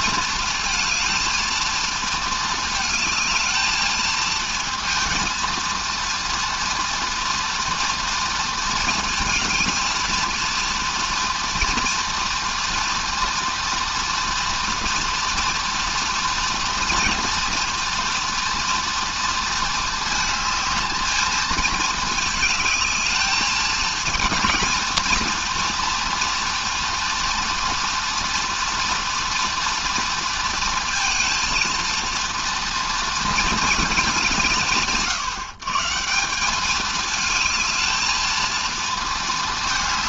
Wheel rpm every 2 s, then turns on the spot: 230, 220, 230, 240, 230, 230, 230, 230, 230, 230, 220, 210, 230, 230, 230, 230, 230, 120, 220, 230.
none